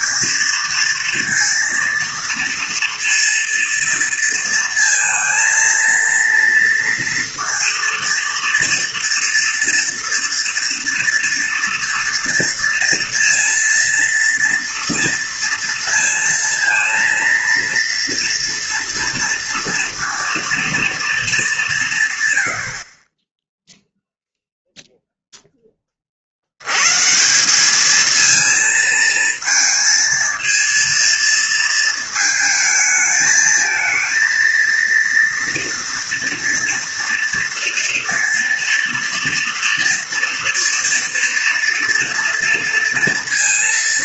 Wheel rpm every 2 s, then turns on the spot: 230, 230, 230, 230, 230, 230, 230, 230, 230, 230, 230, 60, 0, 110, 230, 230, 220, 230, 230, 230, 230, 230.
22-24